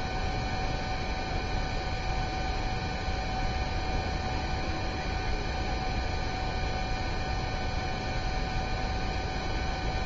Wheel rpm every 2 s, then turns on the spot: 0, 0, 0, 0, 0.
none